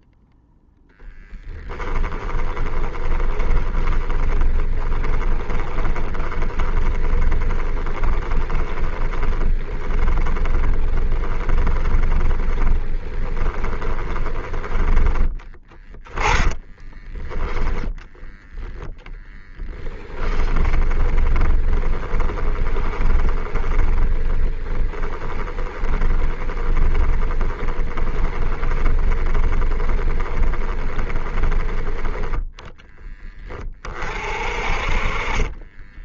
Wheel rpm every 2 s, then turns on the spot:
0, 20, 20, 20, 20, 20, 20, 20, 10, 10, 20, 20, 30, 20, 20, 20, 10, 40.
2-16 20-32 34-36